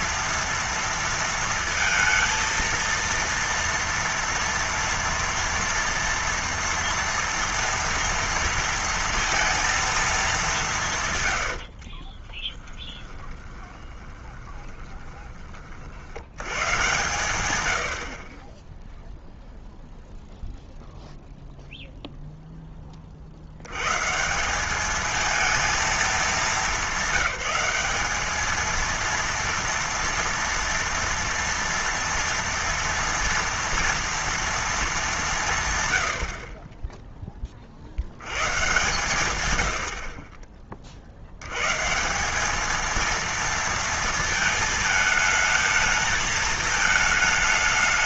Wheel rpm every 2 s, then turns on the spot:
230, 230, 230, 230, 230, 170, 20, 20, 110, 20, 0, 10, 210, 210, 220, 230, 230, 220, 30, 140, 30, 210, 220, 220.
12-16